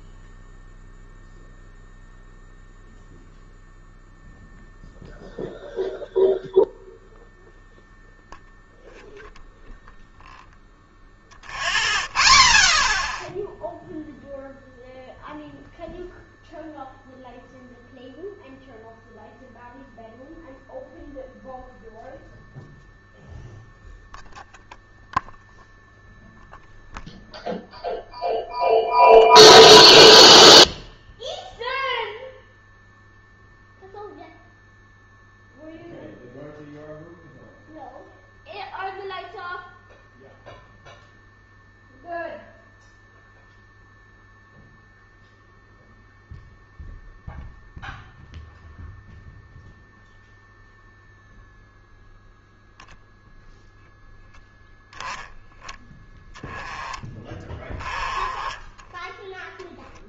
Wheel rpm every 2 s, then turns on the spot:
0, 0, 0, 0, 0, 0, 0, 0, 0, 0, 0, 0, 0, 0, 0, 0, 0, 0, 0, 0, 0, 0, 0, 0, 0, 0, 0, 10, 10, 20.
none